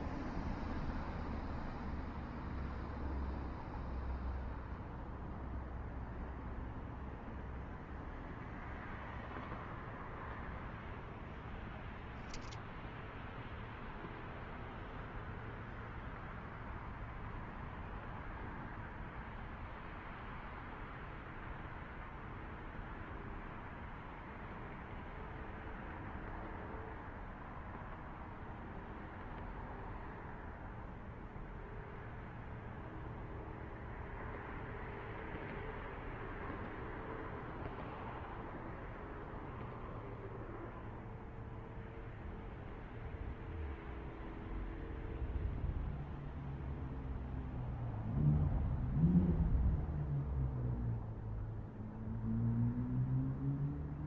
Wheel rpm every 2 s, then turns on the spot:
0, 0, 0, 0, 0, 0, 0, 0, 0, 0, 0, 0, 0, 0, 0, 0, 0, 0, 0, 0, 0, 0, 0, 0, 0, 0, 0.
none